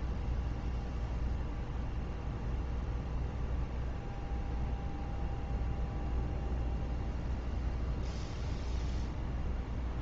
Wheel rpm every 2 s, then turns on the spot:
0, 0, 0, 0, 0.
none